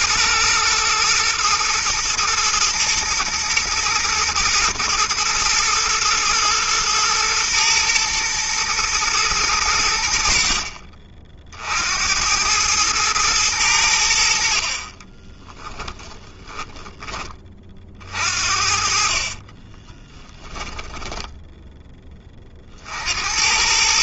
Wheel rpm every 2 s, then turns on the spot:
120, 110, 110, 120, 110, 50, 110, 30, 10, 50, 10, 50.
18-22